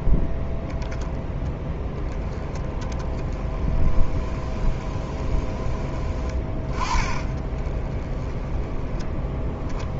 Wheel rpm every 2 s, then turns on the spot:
0, 10, 20, 20, 10.
none